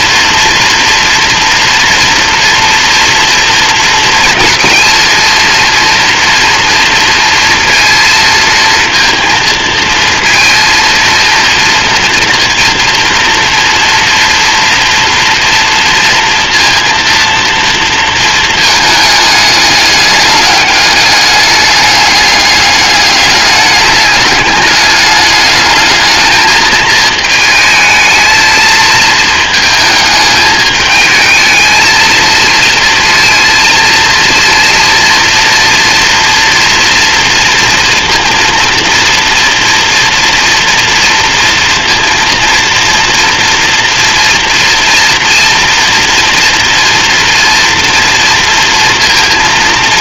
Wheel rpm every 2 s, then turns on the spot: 230, 230, 230, 230, 220, 230, 230, 240, 230, 220, 200, 210, 210, 220, 220, 210, 230, 230, 230, 230, 230, 230, 240, 230, 230.
none